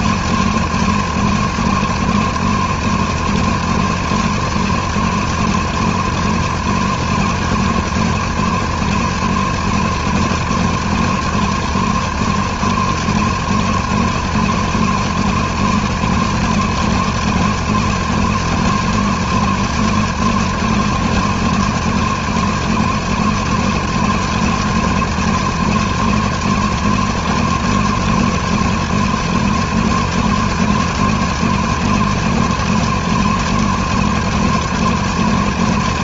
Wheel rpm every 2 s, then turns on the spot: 220, 230, 220, 220, 230, 220, 220, 220, 220, 230, 230, 220, 230, 220, 230, 220, 230, 220.
none